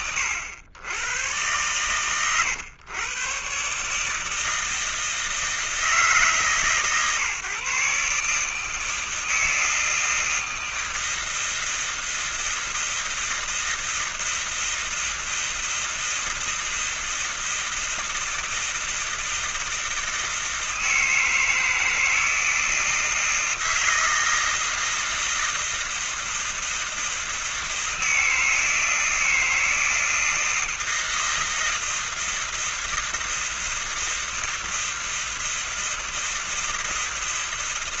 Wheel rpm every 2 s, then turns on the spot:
100, 120, 160, 130, 160, 160, 160, 160, 160, 160, 160, 160, 160, 160, 160, 160, 160, 160, 160.
none